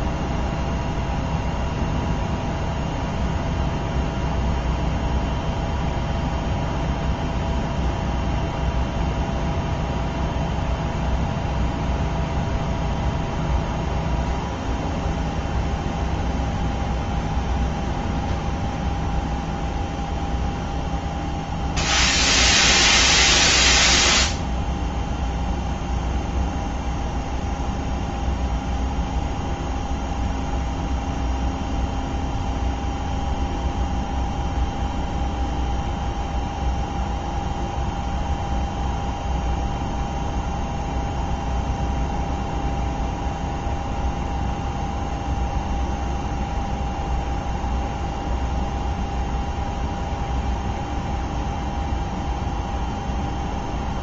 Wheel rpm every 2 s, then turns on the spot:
0, 0, 0, 0, 0, 0, 0, 0, 0, 0, 0, 0, 0, 0, 0, 0, 0, 0, 0, 0, 0, 0, 0, 0, 0, 0, 0.
none